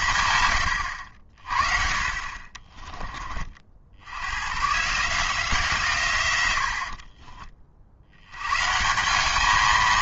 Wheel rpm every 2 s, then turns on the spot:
110, 30, 130, 80, 130.
2-4